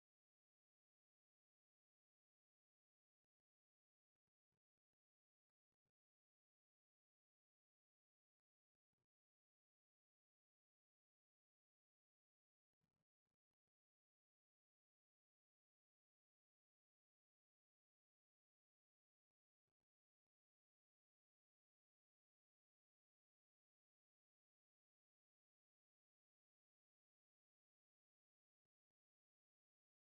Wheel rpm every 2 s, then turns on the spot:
0, 0, 0, 0, 0, 0, 0, 0, 0, 0, 0, 0, 0, 0, 0.
none